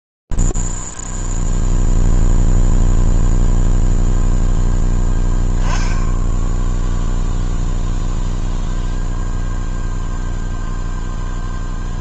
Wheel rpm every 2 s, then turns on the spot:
0, 0, 0, 10, 0, 0.
none